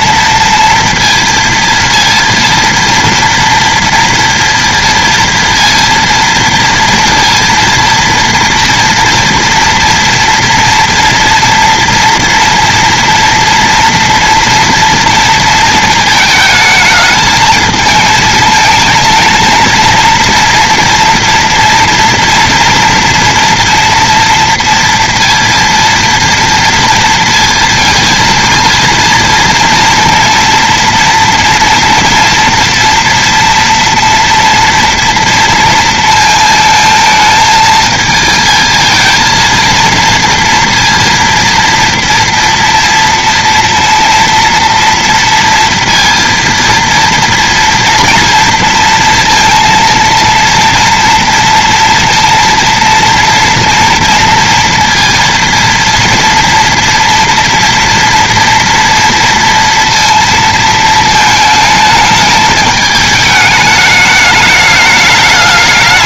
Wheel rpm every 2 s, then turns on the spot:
230, 230, 230, 230, 230, 230, 240, 230, 220, 230, 240, 240, 230, 230, 230, 240, 230, 230, 220, 230, 230, 230, 230, 230, 230, 230, 230, 230, 230, 230, 220, 210, 210.
none